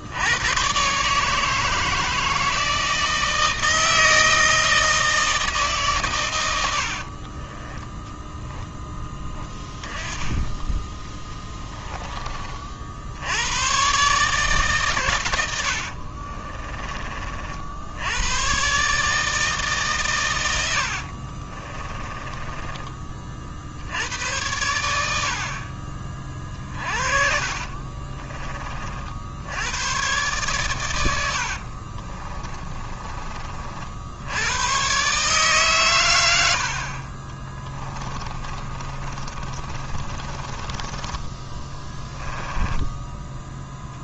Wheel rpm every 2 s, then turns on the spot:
130, 160, 160, 50, 10, 20, 60, 130, 30, 140, 70, 20, 90, 40, 50, 100, 30, 130, 50, 40, 20, 10.
6-8 10-12 20-22 26-28 32-34 38-44